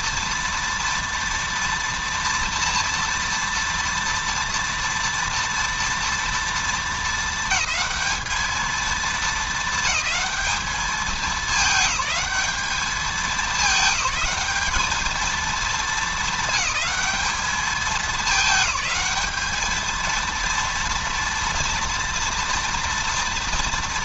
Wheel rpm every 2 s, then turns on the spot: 230, 240, 230, 230, 220, 210, 210, 210, 200, 210, 230, 230.
none